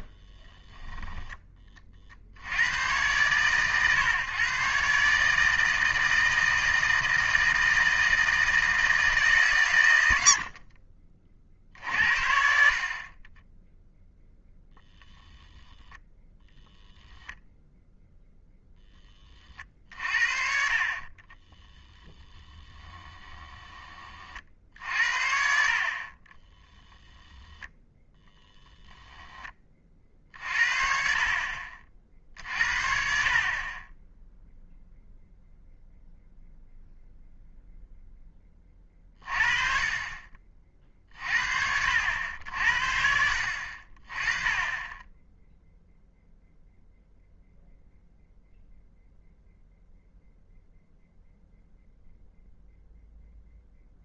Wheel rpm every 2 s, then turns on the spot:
10, 90, 130, 160, 160, 40, 50, 0, 0, 0, 40, 10, 60, 10, 0, 50, 50, 0, 0, 20, 40, 70, 20, 0, 0, 0, 0.
0-2 22-24 26-28